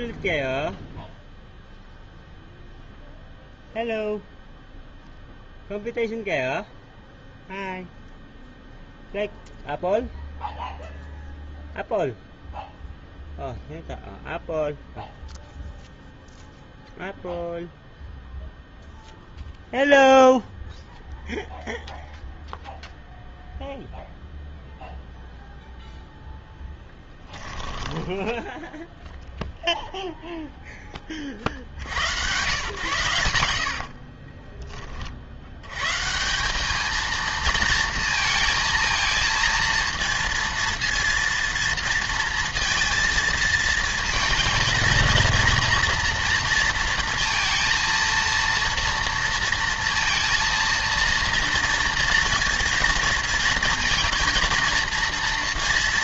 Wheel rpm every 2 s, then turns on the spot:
0, 0, 0, 0, 0, 0, 0, 0, 0, 0, 0, 0, 0, 10, 10, 10, 120, 20, 200, 230, 230, 230, 230, 230, 230, 230, 230, 230.
26-28